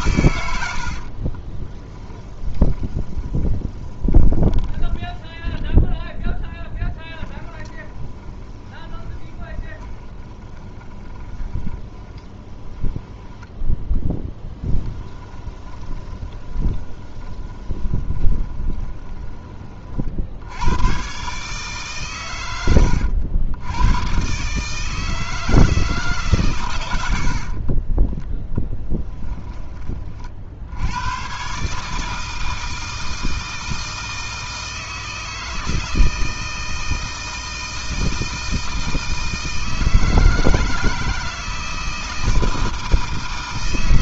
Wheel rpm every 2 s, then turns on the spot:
70, 20, 20, 10, 20, 20, 10, 10, 20, 20, 100, 100, 150, 120, 10, 80, 160, 160, 160, 160, 160, 160.
2-20 28-30